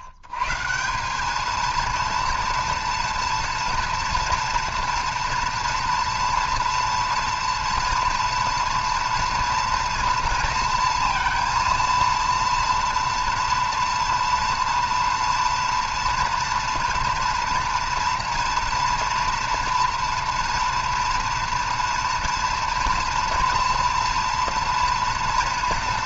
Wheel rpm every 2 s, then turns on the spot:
110, 230, 230, 230, 230, 230, 240, 230, 230, 230, 240, 230, 230.
none